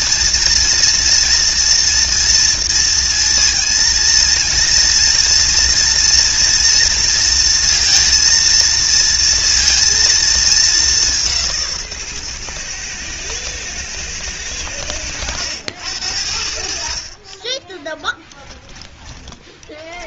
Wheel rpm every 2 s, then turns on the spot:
230, 230, 230, 240, 230, 210, 120, 100, 60, 10.
18-20